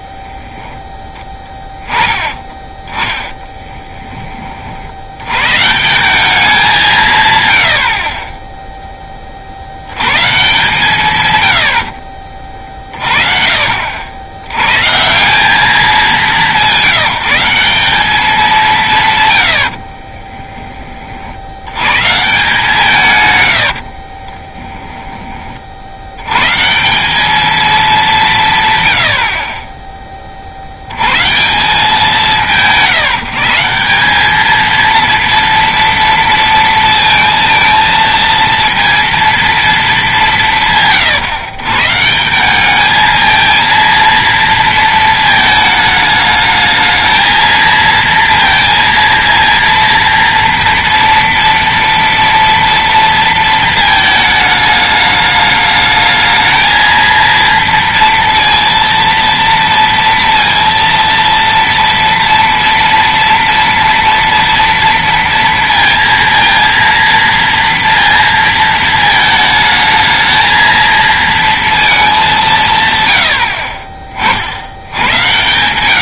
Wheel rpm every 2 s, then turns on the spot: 10, 30, 40, 190, 10, 140, 40, 110, 190, 190, 20, 140, 10, 150, 140, 70, 150, 220, 230, 230, 150, 190, 230, 220, 230, 230, 230, 210, 220, 230, 230, 230, 230, 230, 220, 220, 170, 80.
2-4 12-14 24-26